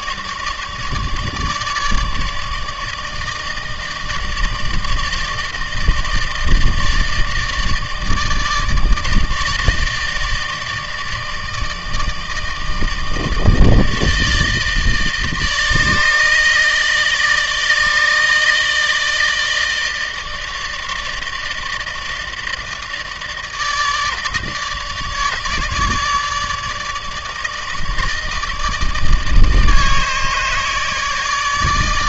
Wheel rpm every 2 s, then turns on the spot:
150, 160, 150, 150, 150, 160, 150, 150, 160, 160, 160, 160, 150, 150, 160, 150.
none